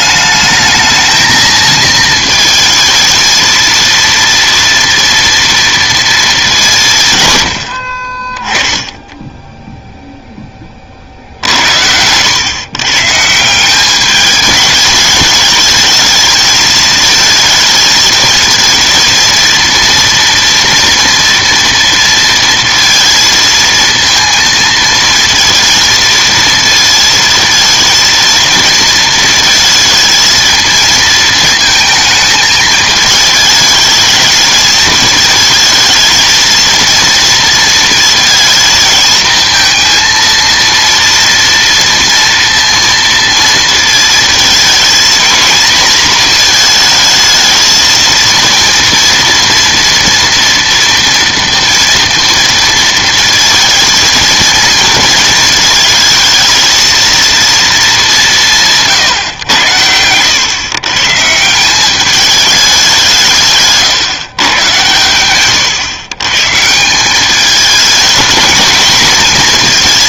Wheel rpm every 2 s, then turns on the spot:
220, 230, 230, 160, 10, 30, 130, 210, 220, 230, 230, 230, 230, 230, 230, 220, 220, 220, 230, 230, 230, 230, 220, 220, 230, 240, 230, 230, 220, 160, 130, 190, 120, 150, 220.
none